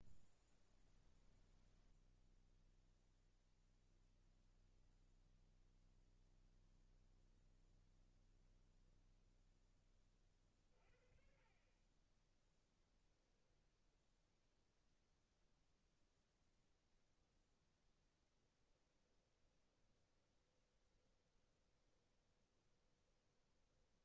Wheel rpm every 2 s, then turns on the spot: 0, 0, 0, 0, 0, 40, 10, 0, 10, 20, 20, 20.
12-14 18-24